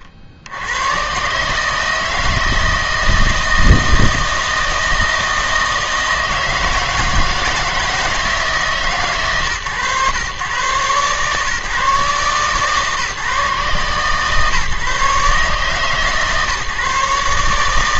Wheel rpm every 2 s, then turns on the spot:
80, 160, 160, 160, 150, 120, 140, 140, 150.
none